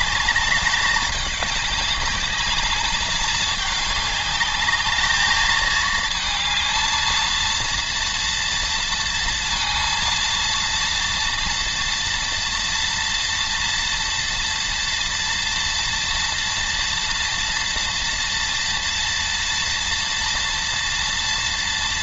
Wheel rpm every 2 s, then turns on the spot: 200, 210, 210, 220, 230, 230, 230, 230, 230, 240, 230.
none